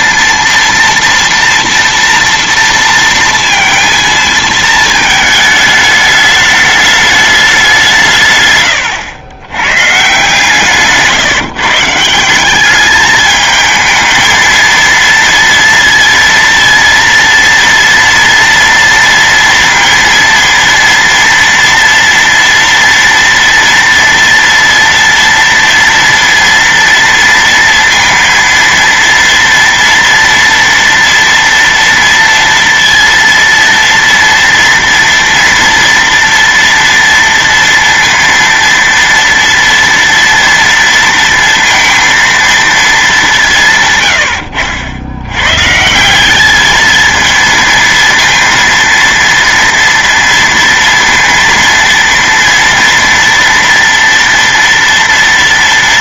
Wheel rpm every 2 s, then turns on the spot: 230, 230, 220, 210, 130, 140, 190, 220, 230, 230, 230, 230, 230, 230, 230, 230, 230, 230, 230, 230, 230, 230, 90, 200, 230, 230, 230, 230.
none